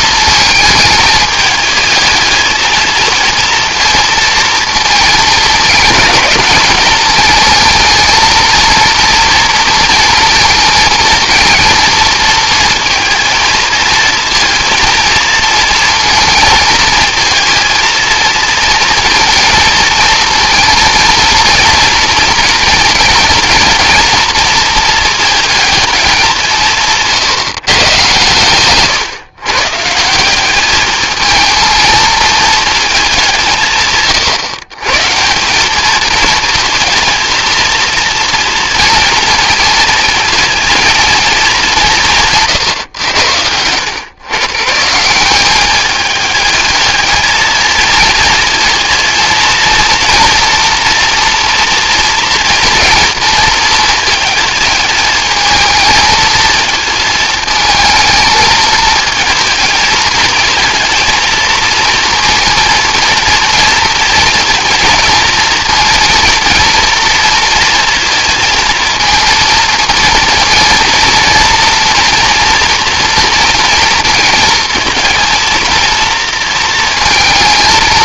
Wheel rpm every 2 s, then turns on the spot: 220, 220, 220, 210, 230, 230, 230, 230, 220, 230, 230, 230, 230, 160, 120, 210, 210, 130, 230, 230, 230, 120, 140, 220, 230, 230, 230, 220, 220, 220, 230, 230, 230, 230, 220, 230, 240, 230, 230.
none